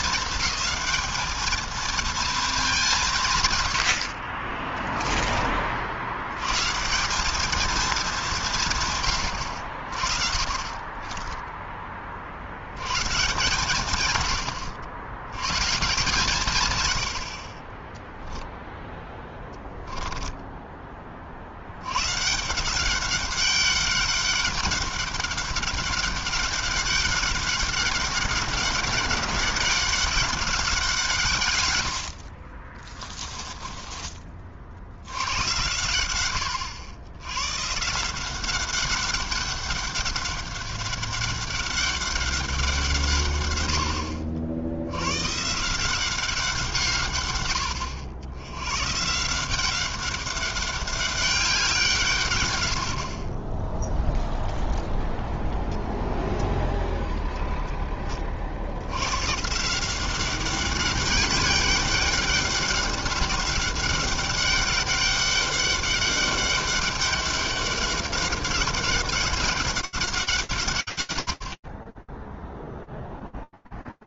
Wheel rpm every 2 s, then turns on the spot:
220, 140, 20, 200, 100, 10, 150, 110, 50, 10, 60, 200, 200, 200, 200, 140, 10, 100, 110, 200, 200, 120, 120, 130, 170, 190, 30, 0, 0, 140, 200, 200, 200, 200, 200, 70, 0.
8-12 18-20 32-34